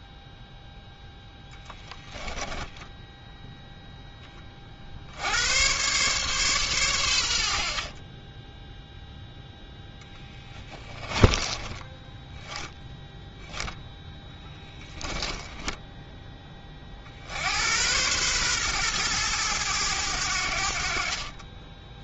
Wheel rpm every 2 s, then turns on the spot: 0, 10, 60, 110, 0, 20, 10, 10, 40, 120, 60.
2-4 10-12 14-16